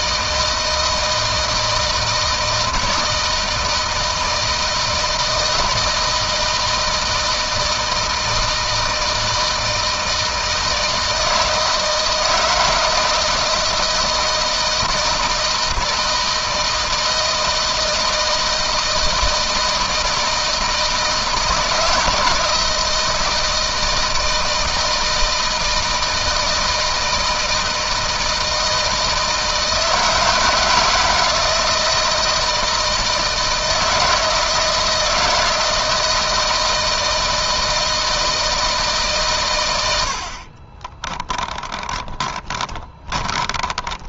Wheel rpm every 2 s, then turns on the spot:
170, 160, 160, 160, 160, 160, 160, 160, 160, 160, 160, 160, 160, 160, 160, 160, 160, 160, 160, 150, 30, 20.
40-44